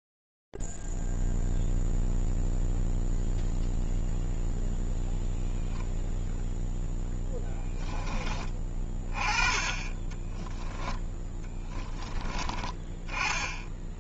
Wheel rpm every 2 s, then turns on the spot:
0, 0, 0, 0, 20, 20, 30.
10-12